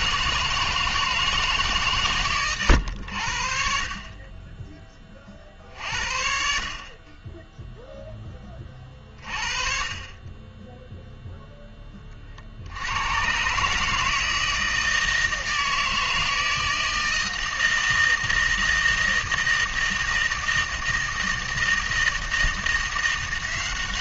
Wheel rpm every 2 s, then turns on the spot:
160, 100, 20, 50, 30, 10, 70, 160, 160, 160, 160, 170.
none